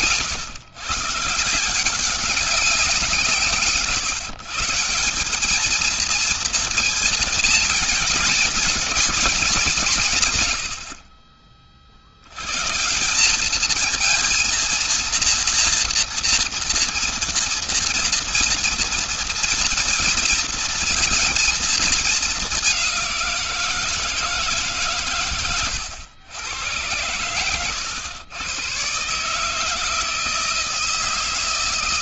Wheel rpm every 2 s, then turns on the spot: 130, 190, 160, 230, 220, 110, 110, 230, 230, 230, 230, 200, 150, 110, 120, 160.
none